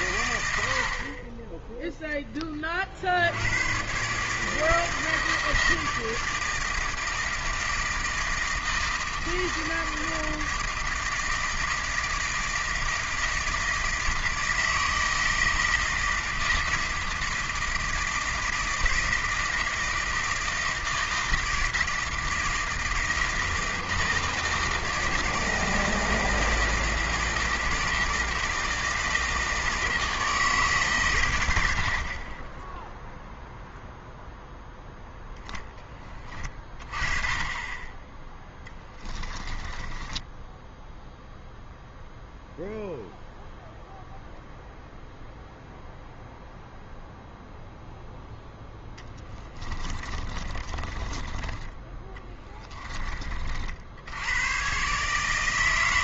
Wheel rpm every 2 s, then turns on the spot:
80, 30, 160, 160, 160, 160, 160, 160, 160, 160, 160, 160, 160, 160, 160, 150, 10, 10, 30, 10, 10, 0, 0, 0, 0, 30, 20, 130.
38-42 50-54